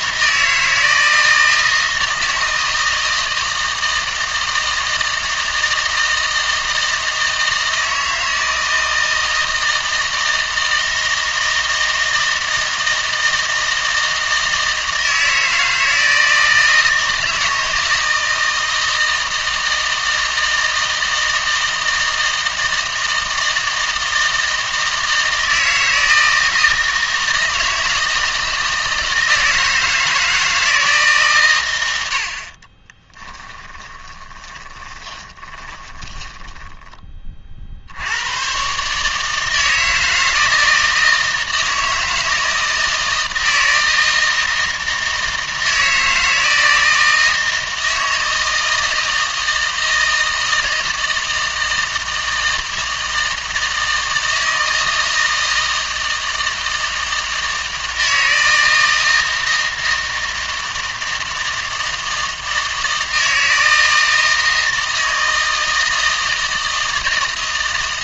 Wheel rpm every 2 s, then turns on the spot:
160, 160, 160, 160, 160, 160, 160, 160, 160, 160, 160, 160, 160, 160, 160, 150, 20, 20, 10, 140, 160, 160, 160, 160, 160, 160, 160, 160, 160, 160, 160, 160, 160, 160.
32-36